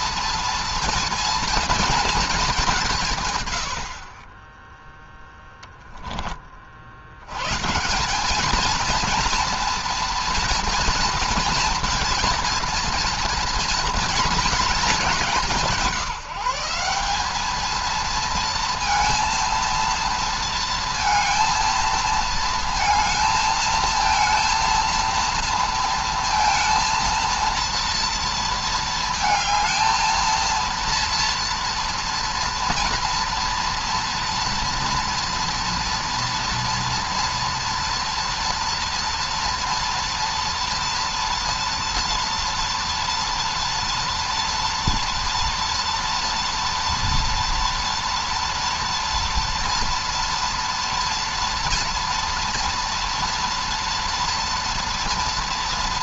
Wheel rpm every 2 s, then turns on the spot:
240, 190, 20, 40, 210, 230, 230, 220, 180, 230, 230, 220, 230, 230, 230, 230, 240, 230, 230, 240, 240, 230, 230, 230, 230, 230, 230, 230.
none